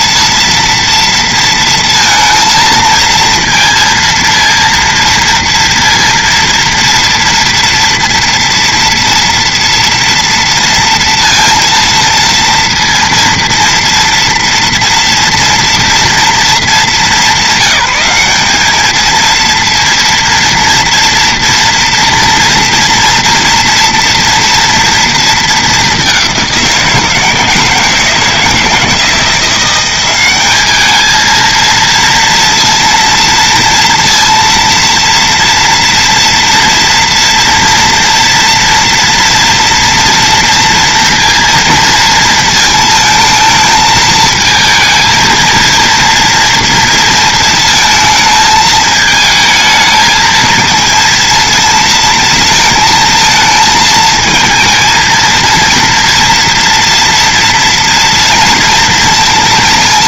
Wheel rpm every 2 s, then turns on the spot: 230, 230, 230, 230, 230, 230, 230, 240, 210, 200, 230, 230, 230, 180, 160, 210, 230, 230, 230, 230, 230, 230, 230, 230, 220, 220, 230, 220, 230, 230.
none